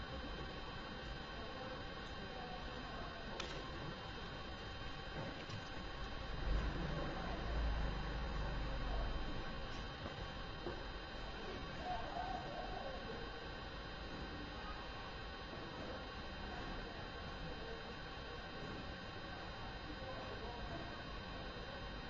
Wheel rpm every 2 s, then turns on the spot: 0, 0, 0, 0, 0, 0, 0, 0, 0, 0, 0.
none